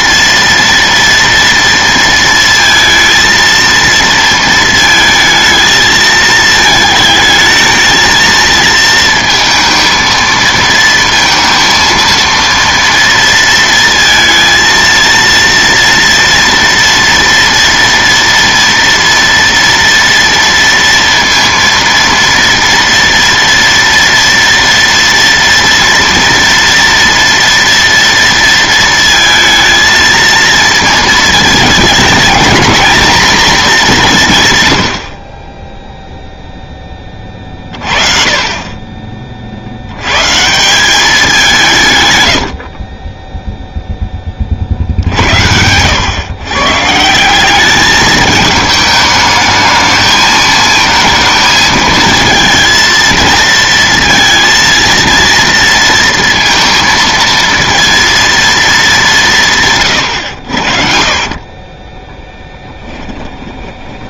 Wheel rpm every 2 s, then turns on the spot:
230, 230, 230, 220, 230, 230, 230, 230, 230, 230, 230, 230, 230, 230, 230, 230, 220, 120, 10, 30, 180, 50, 40, 120, 210, 220, 230, 230, 230, 220, 70, 10.
60-64